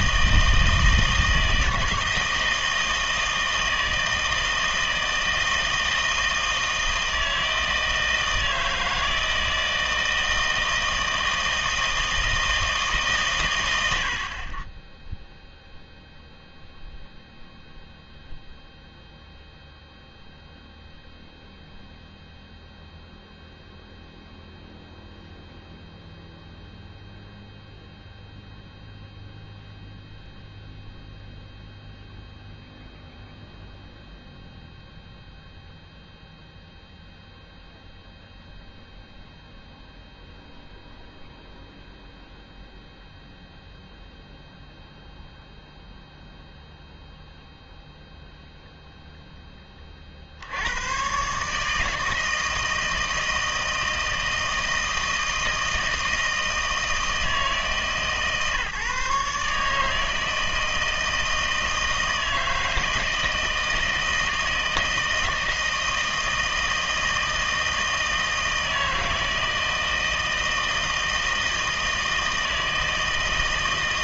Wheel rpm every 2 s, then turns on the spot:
160, 160, 160, 160, 160, 160, 160, 30, 0, 0, 0, 0, 0, 0, 0, 0, 0, 0, 0, 0, 0, 0, 0, 0, 0, 90, 160, 160, 160, 140, 160, 160, 160, 160, 160, 160, 160.
none